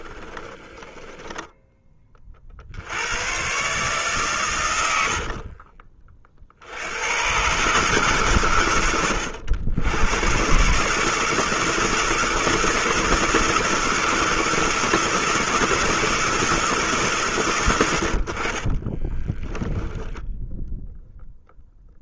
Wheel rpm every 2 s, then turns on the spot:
10, 80, 100, 90, 100, 150, 160, 160, 160, 30, 0.
0-2 4-6 18-20